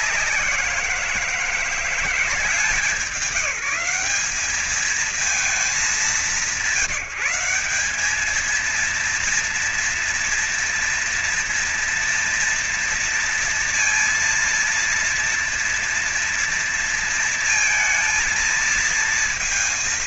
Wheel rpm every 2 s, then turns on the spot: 190, 170, 190, 190, 210, 240, 230, 230, 230, 220.
none